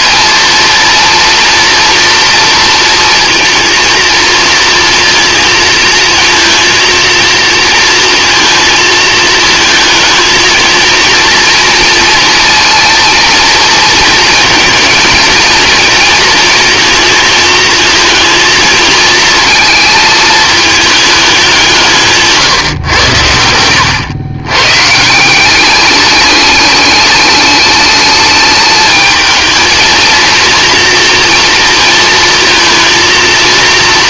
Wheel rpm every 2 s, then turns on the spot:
230, 230, 230, 230, 220, 230, 230, 220, 230, 220, 210, 110, 150, 210, 220, 240, 230.
none